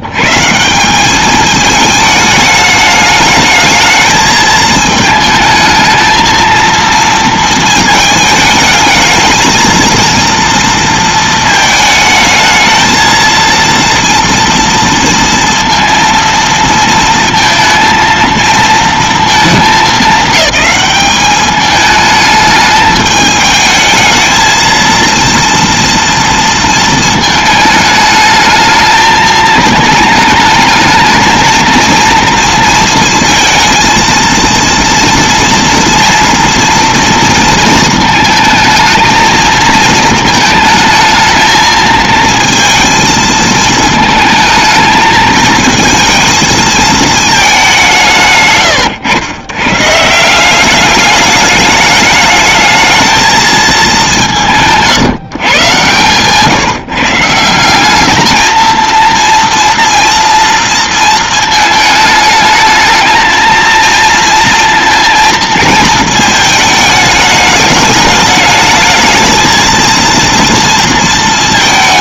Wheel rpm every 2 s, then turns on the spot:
170, 210, 220, 230, 220, 230, 220, 230, 230, 230, 210, 210, 230, 230, 220, 220, 230, 230, 230, 220, 220, 230, 220, 220, 130, 190, 220, 150, 150, 220, 230, 220, 230, 220, 220, 230.
none